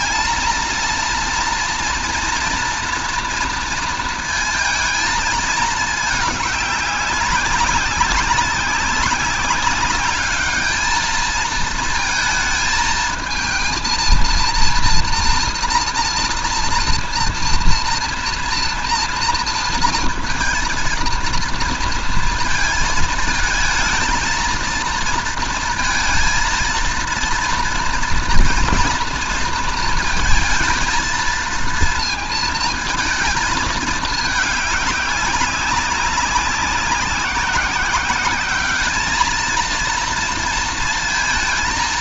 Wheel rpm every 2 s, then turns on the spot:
230, 230, 230, 210, 190, 210, 220, 230, 230, 230, 230, 230, 230, 230, 230, 220, 220, 210, 190, 210, 230.
none